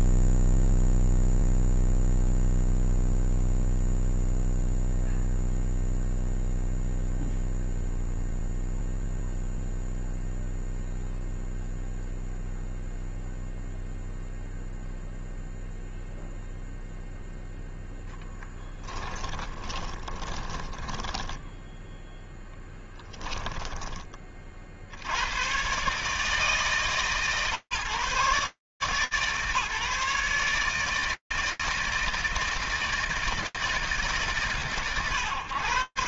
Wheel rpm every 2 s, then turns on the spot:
0, 0, 0, 0, 0, 0, 0, 0, 0, 10, 30, 10, 20, 140, 150, 150, 160, 110.
20-24